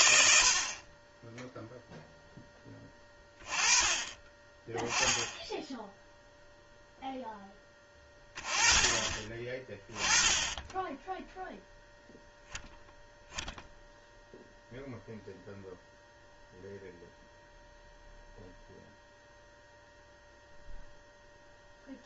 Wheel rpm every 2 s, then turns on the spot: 60, 10, 20, 0, 20, 10, 0, 0, 0, 0, 0.
none